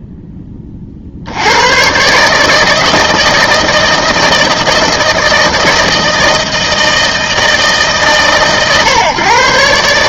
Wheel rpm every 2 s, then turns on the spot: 50, 160, 160, 160, 130.
none